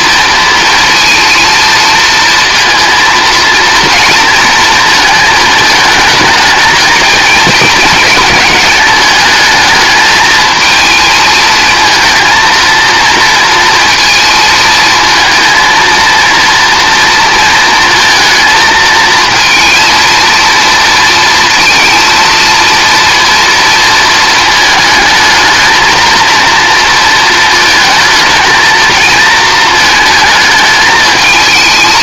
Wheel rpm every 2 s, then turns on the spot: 230, 230, 220, 220, 210, 220, 230, 220, 230, 230, 230, 230, 220, 230, 230, 220.
none